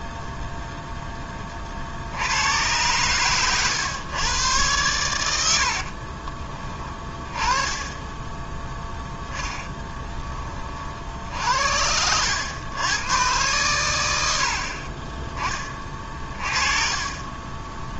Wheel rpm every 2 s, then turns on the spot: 0, 100, 110, 20, 10, 40, 100, 50, 30.
none